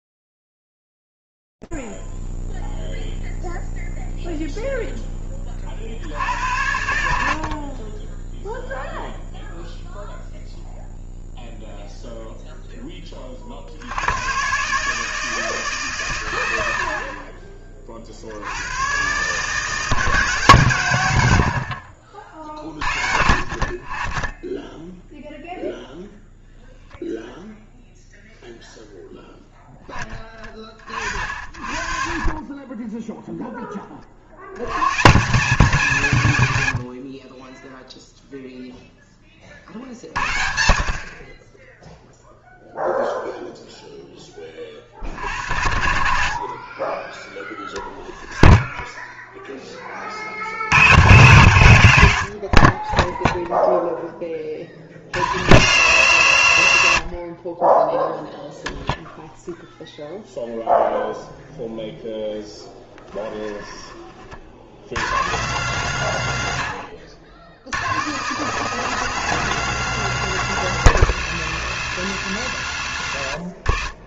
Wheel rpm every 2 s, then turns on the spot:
0, 0, 0, 60, 20, 0, 0, 90, 120, 70, 150, 50, 20, 0, 0, 40, 20, 90, 80, 0, 70, 0, 40, 40, 10, 100, 20, 40, 50, 0, 10, 10, 70, 100, 180, 150, 70.
36-38 48-50